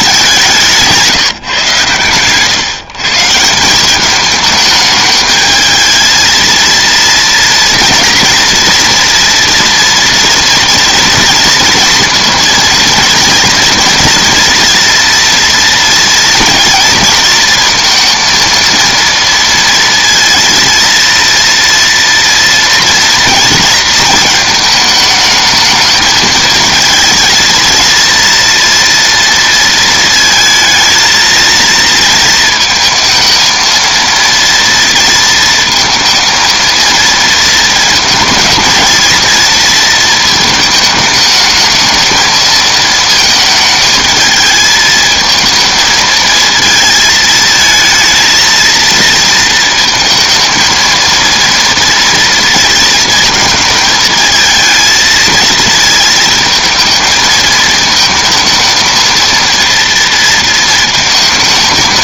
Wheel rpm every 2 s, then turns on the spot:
170, 130, 210, 230, 240, 230, 230, 230, 230, 230, 230, 230, 220, 220, 230, 230, 220, 230, 230, 230, 220, 220, 220, 220, 230, 220, 230, 220, 220, 230, 220.
none